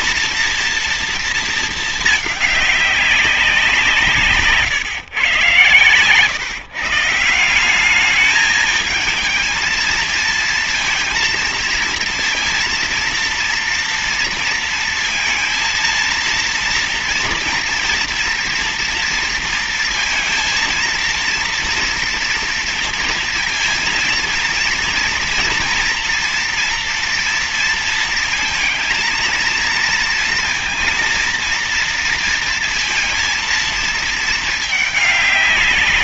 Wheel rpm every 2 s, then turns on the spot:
230, 200, 150, 150, 220, 230, 230, 230, 230, 230, 230, 230, 230, 230, 230, 230, 230, 210.
none